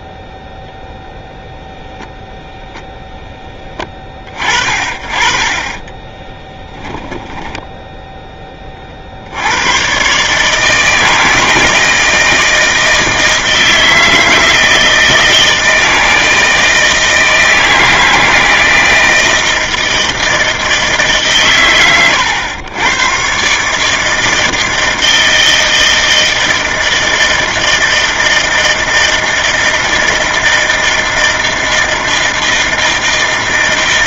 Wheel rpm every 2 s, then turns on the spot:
0, 10, 50, 10, 20, 150, 160, 170, 160, 160, 160, 110, 160, 160, 160, 160, 160.
6-8